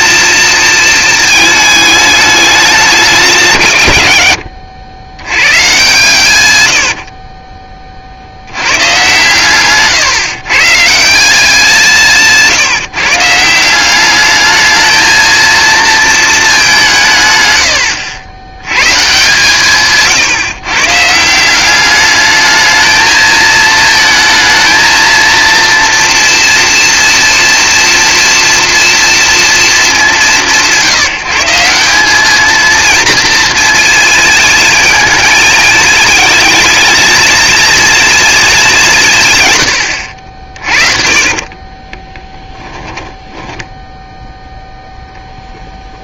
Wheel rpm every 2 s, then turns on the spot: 220, 200, 90, 80, 100, 130, 150, 210, 220, 110, 140, 210, 230, 230, 230, 180, 220, 230, 230, 210, 40, 10, 0.
6-8 42-44